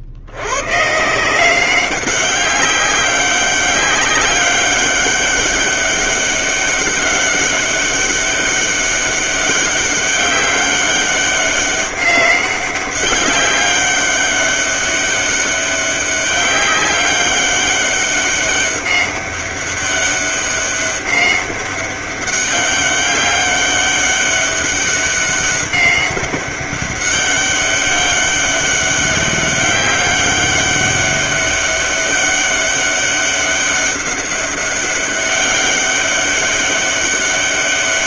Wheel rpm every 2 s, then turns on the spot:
120, 190, 190, 200, 200, 200, 200, 200, 200, 200, 200, 200, 200, 200, 200, 200, 200, 200, 200.
none